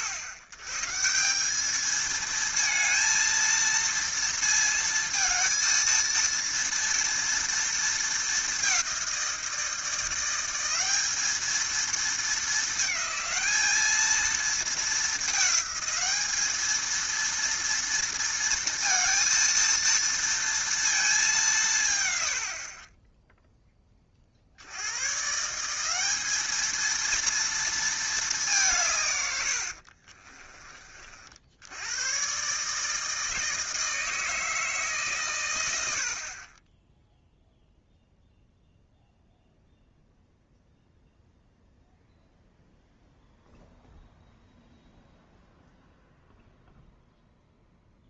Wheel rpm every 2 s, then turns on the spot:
110, 230, 230, 230, 200, 190, 210, 220, 220, 230, 230, 40, 80, 220, 170, 30, 150, 150, 20, 0, 0, 0, 0, 0.
none